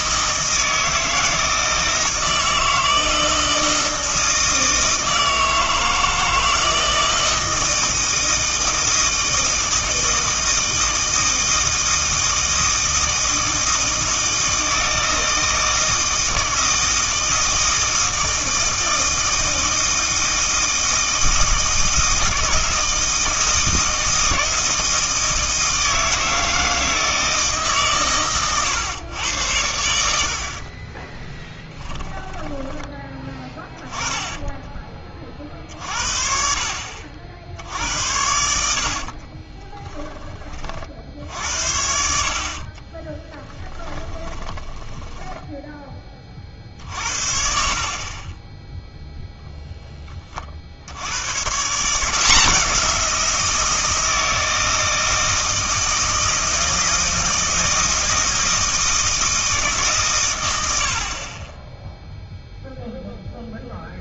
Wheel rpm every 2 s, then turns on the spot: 160, 160, 160, 160, 160, 160, 160, 160, 160, 160, 160, 160, 160, 160, 110, 50, 20, 20, 60, 80, 40, 40, 20, 50, 10, 60, 170, 160, 160, 160, 100, 0.
34-36 42-46